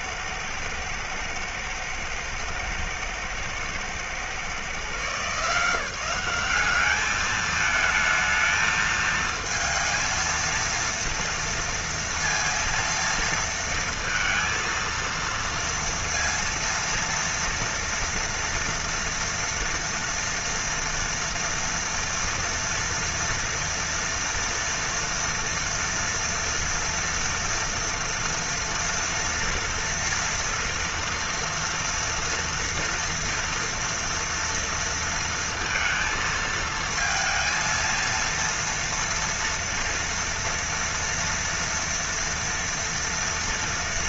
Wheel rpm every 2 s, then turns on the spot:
110, 110, 130, 190, 220, 230, 230, 230, 230, 230, 230, 230, 230, 240, 230, 230, 240, 240, 220, 230, 230, 230.
none